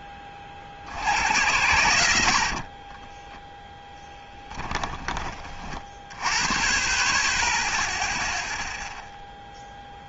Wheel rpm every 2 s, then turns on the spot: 40, 50, 10, 30, 0.
2-4